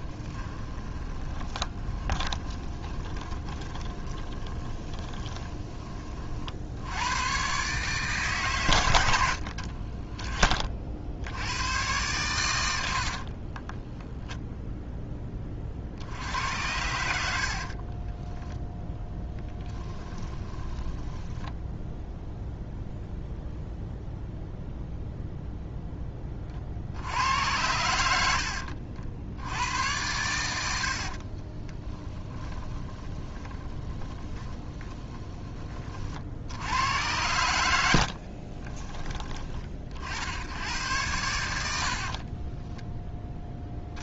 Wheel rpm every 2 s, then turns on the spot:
20, 20, 20, 70, 110, 30, 80, 0, 100, 10, 20, 0, 0, 50, 60, 70, 20, 20, 100, 30, 100, 10.
0-6 12-14 20-22 30-36 38-40